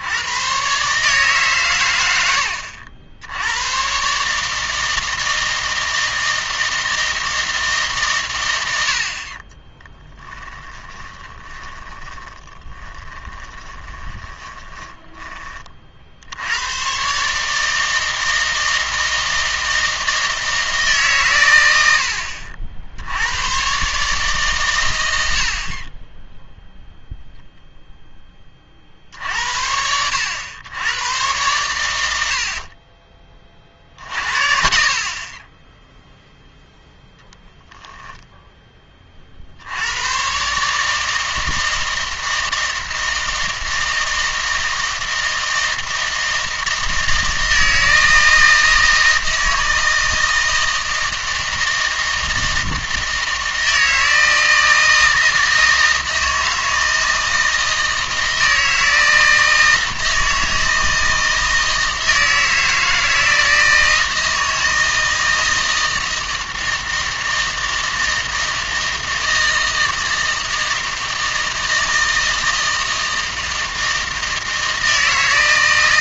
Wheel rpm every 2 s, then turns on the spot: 130, 80, 160, 160, 90, 20, 10, 20, 120, 160, 150, 70, 100, 0, 60, 100, 40, 50, 0, 20, 150, 160, 160, 160, 160, 160, 160, 160, 160, 160, 160, 160, 160, 160, 160, 160, 160, 160.
10-16